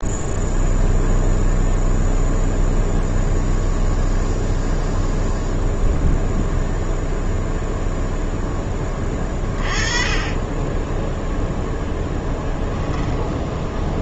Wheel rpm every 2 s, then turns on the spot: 0, 0, 0, 0, 20, 10, 10.
10-14